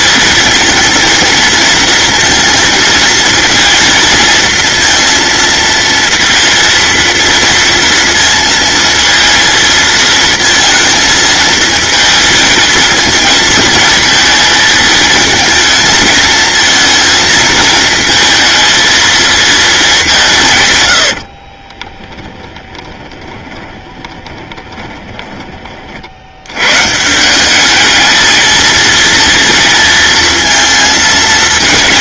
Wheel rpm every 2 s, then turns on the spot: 230, 230, 230, 230, 230, 220, 220, 220, 230, 220, 50, 20, 20, 170, 230, 230.
20-26